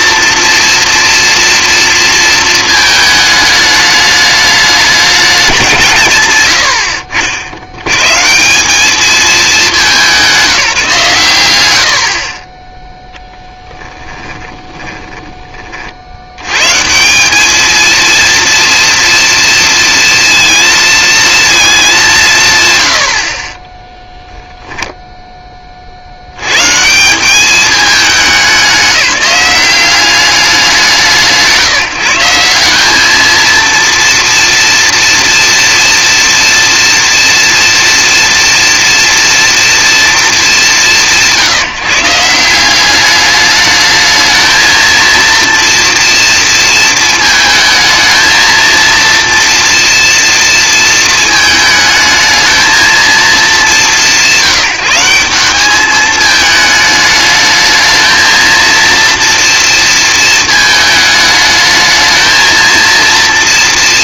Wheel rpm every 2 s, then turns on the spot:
230, 220, 200, 60, 210, 150, 0, 10, 130, 230, 230, 170, 0, 120, 190, 180, 190, 230, 230, 240, 170, 180, 220, 230, 230, 230, 220, 160, 220, 230, 220, 230.
14-16